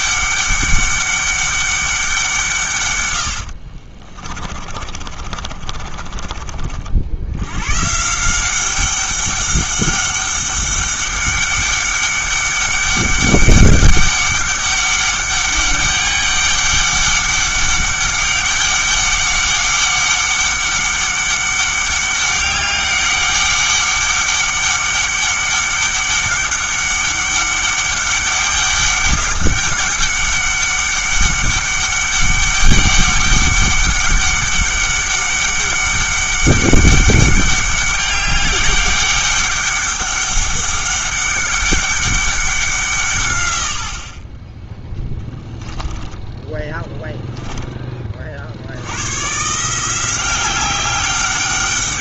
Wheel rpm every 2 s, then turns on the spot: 200, 140, 30, 40, 190, 200, 200, 200, 200, 200, 200, 200, 200, 200, 190, 200, 200, 200, 200, 200, 200, 180, 10, 20, 60, 190.
4-6 46-48